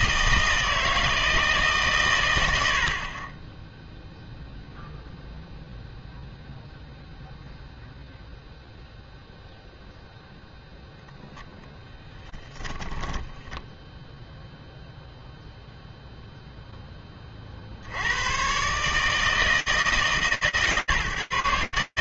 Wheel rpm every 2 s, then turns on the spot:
160, 80, 0, 0, 0, 0, 10, 0, 70, 160, 150.
none